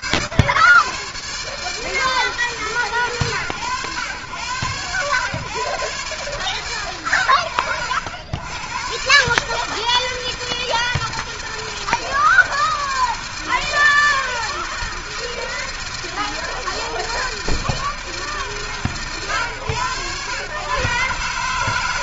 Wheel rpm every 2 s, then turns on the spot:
90, 140, 110, 100, 120, 160, 160, 160, 160, 120, 130.
none